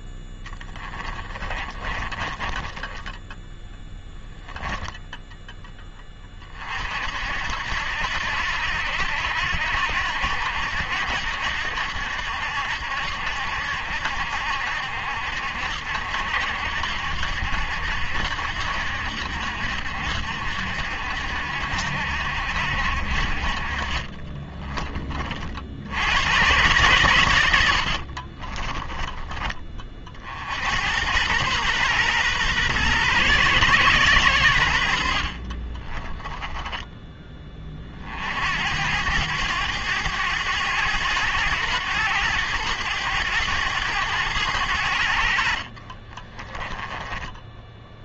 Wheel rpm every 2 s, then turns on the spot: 10, 20, 0, 40, 80, 70, 70, 70, 70, 70, 70, 60, 20, 110, 20, 70, 120, 90, 10, 80, 100, 100, 90, 20.
0-4 24-26 28-30 46-48